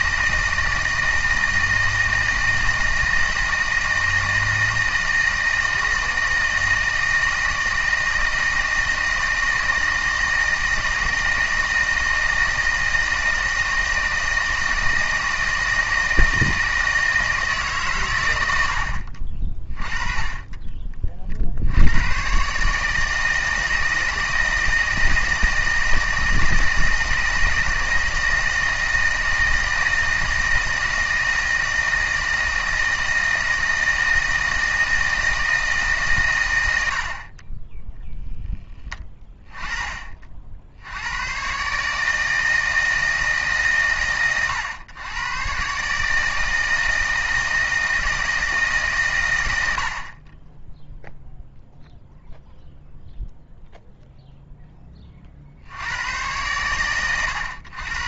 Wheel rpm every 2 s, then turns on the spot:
160, 160, 160, 160, 160, 160, 160, 160, 160, 70, 20, 140, 160, 160, 160, 160, 160, 160, 100, 10, 60, 160, 100, 160, 150, 10, 0, 0, 110.
none